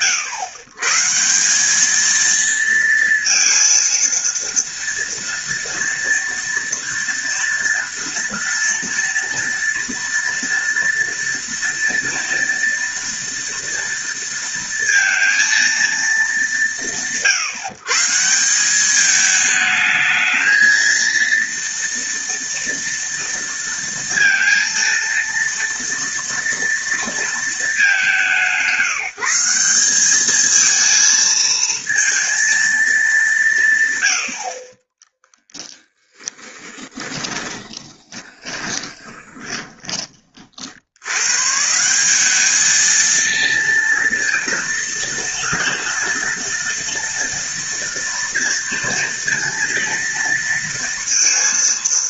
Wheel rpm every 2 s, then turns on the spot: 150, 230, 230, 230, 230, 230, 230, 230, 170, 190, 220, 230, 230, 230, 170, 220, 220, 30, 20, 20, 80, 220, 230, 230, 230, 230.
36-40